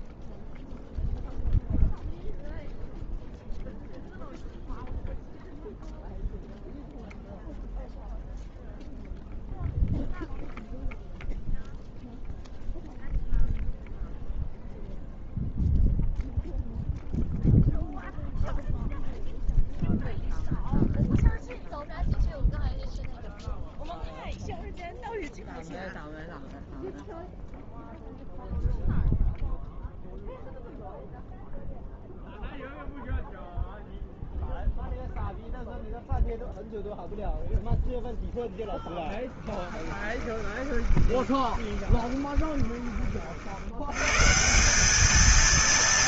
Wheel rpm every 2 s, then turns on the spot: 0, 0, 0, 0, 0, 0, 0, 0, 0, 0, 0, 0, 0, 0, 0, 0, 0, 0, 0, 0, 20, 20, 150.
40-44